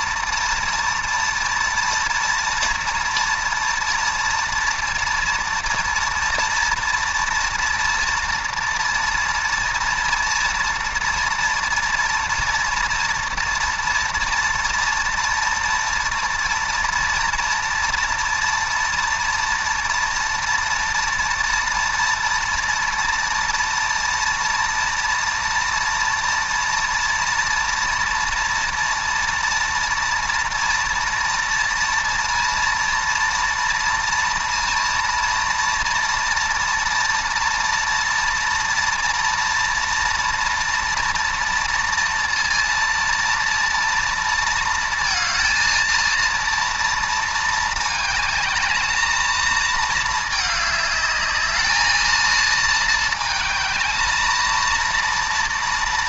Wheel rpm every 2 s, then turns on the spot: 230, 230, 230, 240, 230, 230, 230, 230, 230, 240, 230, 230, 230, 230, 230, 240, 230, 230, 230, 230, 230, 230, 230, 230, 220, 210, 220, 230.
none